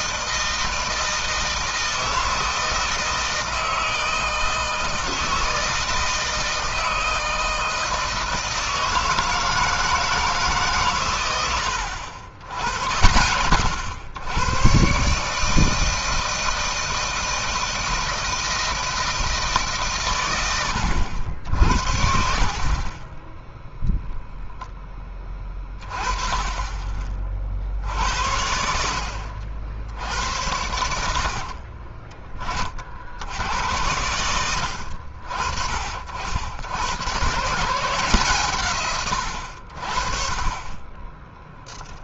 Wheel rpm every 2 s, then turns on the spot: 160, 160, 160, 160, 160, 140, 80, 120, 160, 160, 90, 50, 10, 20, 60, 80, 40, 70, 90, 130, 20.
none